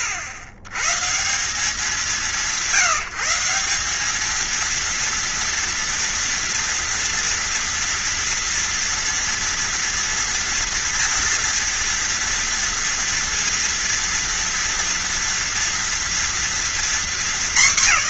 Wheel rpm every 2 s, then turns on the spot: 130, 160, 230, 230, 240, 240, 240, 240, 240.
none